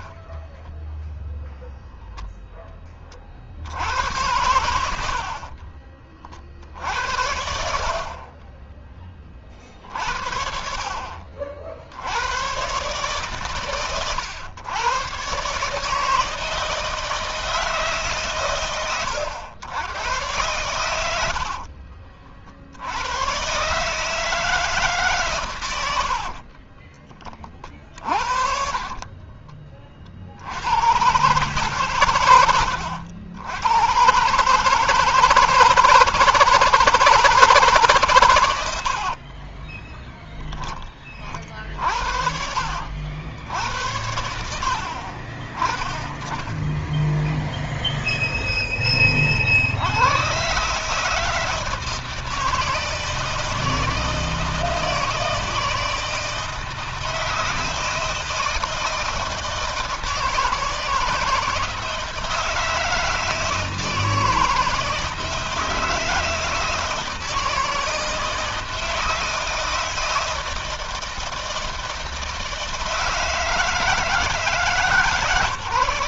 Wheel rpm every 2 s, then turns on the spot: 10, 10, 80, 60, 30, 60, 100, 110, 160, 120, 100, 50, 150, 60, 40, 90, 110, 150, 160, 110, 20, 60, 80, 20, 0, 130, 160, 160, 160, 160, 160, 160, 160, 160, 160, 160, 160, 150.
0-2 26-30 38-42